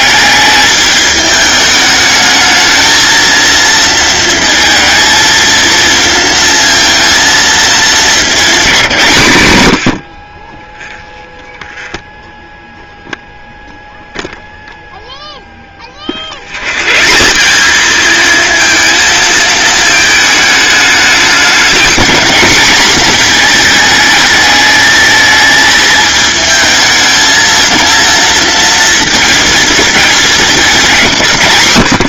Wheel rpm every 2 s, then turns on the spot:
210, 220, 230, 230, 190, 10, 0, 0, 130, 230, 210, 220, 220, 220, 220, 170.
none